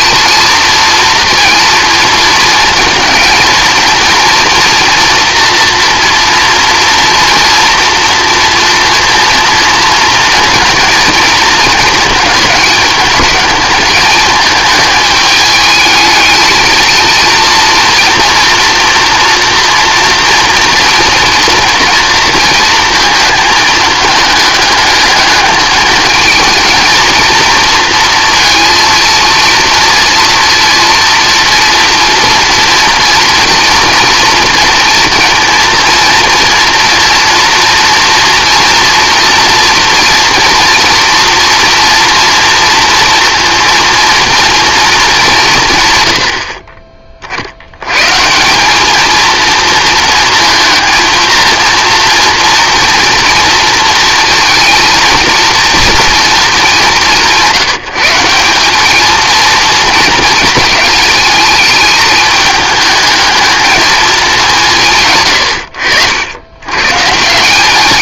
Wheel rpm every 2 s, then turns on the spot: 230, 230, 230, 230, 230, 230, 210, 210, 220, 240, 230, 230, 210, 220, 230, 230, 230, 230, 230, 230, 230, 230, 220, 40, 210, 230, 230, 230, 190, 210, 230, 220, 160, 120.
none